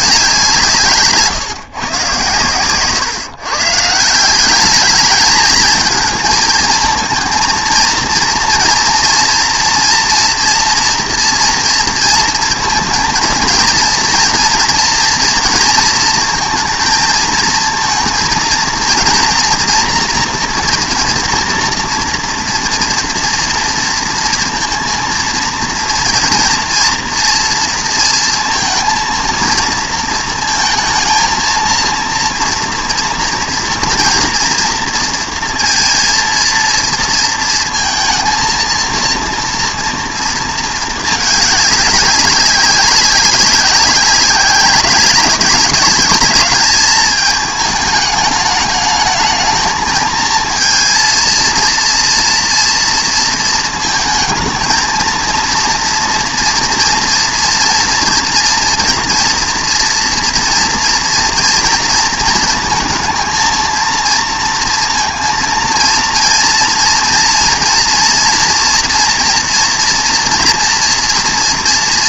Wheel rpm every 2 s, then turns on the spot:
150, 140, 210, 230, 230, 240, 230, 230, 220, 230, 240, 240, 230, 230, 230, 220, 230, 230, 230, 230, 220, 190, 200, 210, 210, 230, 230, 230, 240, 230, 230, 230, 230, 230, 240, 240.
2-4